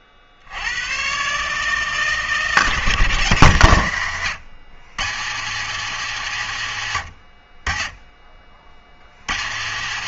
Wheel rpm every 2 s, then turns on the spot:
70, 160, 140, 160, 50.
none